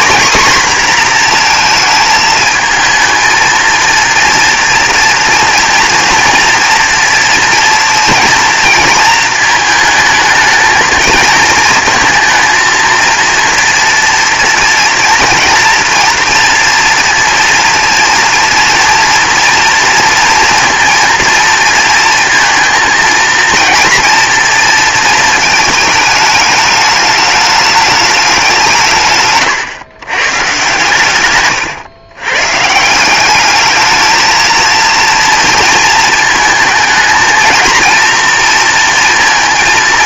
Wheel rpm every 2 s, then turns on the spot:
240, 220, 240, 230, 230, 220, 230, 230, 230, 230, 230, 220, 230, 210, 150, 130, 160, 230, 220, 230.
none